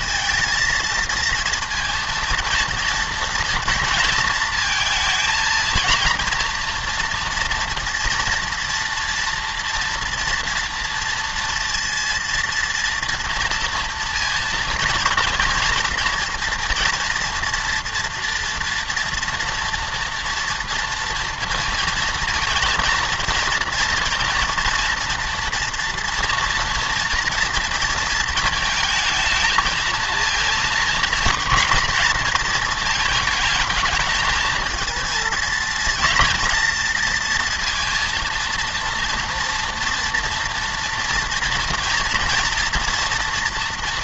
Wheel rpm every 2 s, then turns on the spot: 230, 230, 230, 230, 240, 240, 230, 230, 230, 230, 230, 230, 230, 230, 220, 220, 220, 220, 230, 230, 230, 230.
none